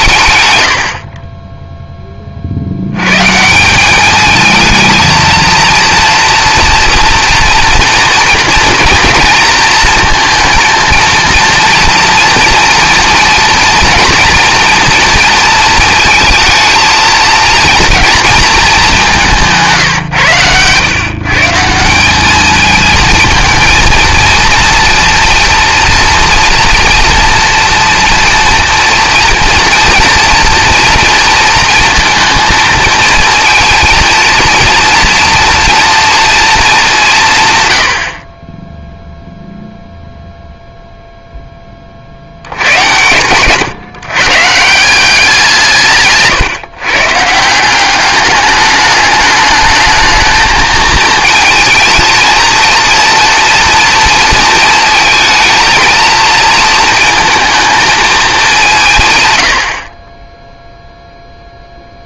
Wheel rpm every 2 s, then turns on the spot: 90, 90, 220, 230, 230, 230, 230, 230, 230, 210, 120, 220, 230, 230, 230, 230, 230, 230, 200, 10, 0, 110, 170, 140, 210, 220, 230, 220, 230, 170, 0.
none